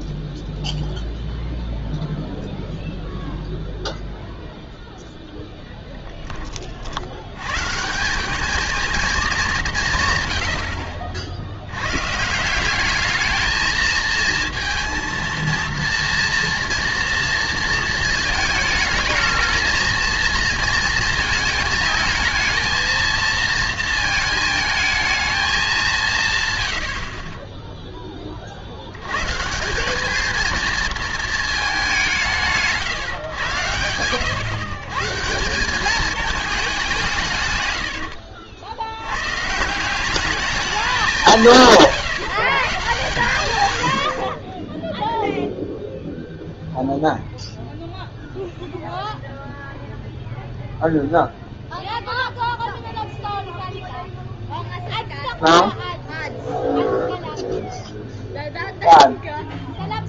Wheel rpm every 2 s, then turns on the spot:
0, 0, 0, 40, 220, 60, 190, 230, 230, 220, 230, 220, 220, 100, 80, 230, 150, 120, 200, 90, 210, 140, 10, 0, 0, 0, 0, 0, 0, 0.
none